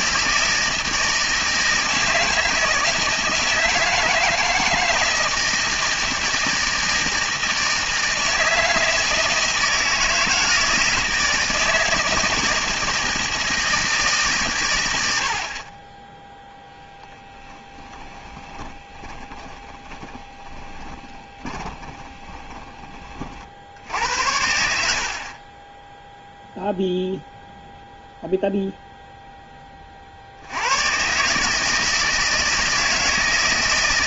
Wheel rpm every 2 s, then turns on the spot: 160, 160, 160, 160, 160, 160, 160, 120, 0, 20, 20, 20, 80, 0, 0, 90, 160.
18-24